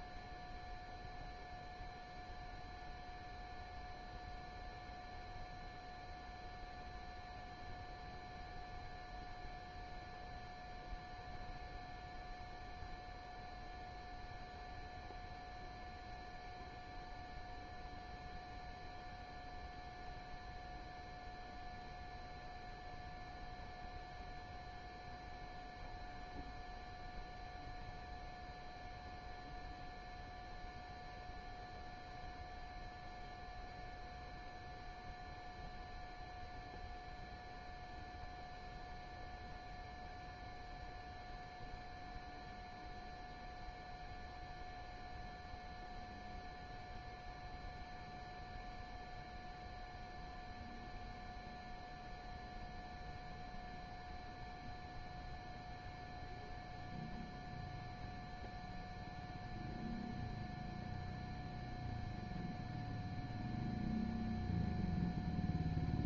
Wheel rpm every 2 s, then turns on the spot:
0, 0, 0, 0, 0, 0, 0, 0, 0, 0, 0, 0, 0, 0, 0, 0, 0, 0, 0, 0, 0, 0, 0, 0, 0, 0, 0, 0, 0, 0, 0, 0, 0.
none